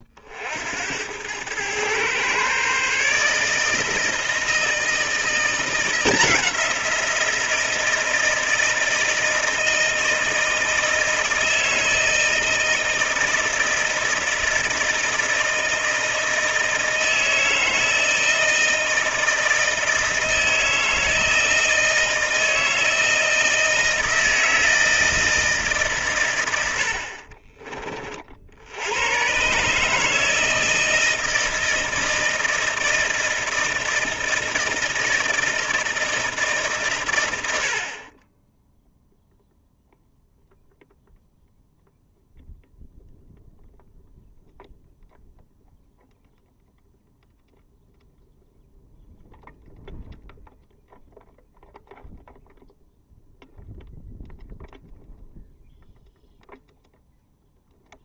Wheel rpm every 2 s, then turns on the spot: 70, 130, 170, 180, 160, 160, 160, 160, 160, 160, 160, 160, 160, 90, 80, 160, 160, 160, 140, 0, 0, 0, 0, 0, 0, 0, 0, 0, 0.
none